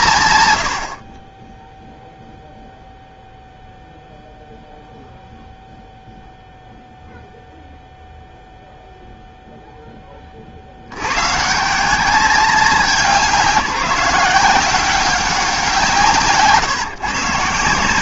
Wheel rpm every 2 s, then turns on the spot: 110, 0, 0, 0, 0, 50, 200, 180, 140.
none